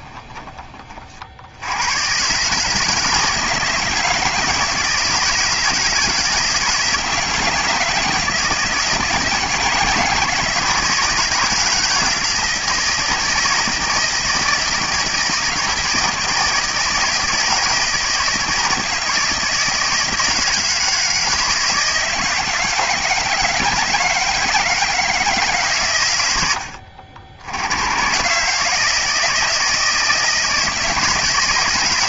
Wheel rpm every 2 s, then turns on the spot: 40, 160, 160, 160, 160, 160, 160, 160, 160, 160, 160, 160, 160, 80, 150, 170.
none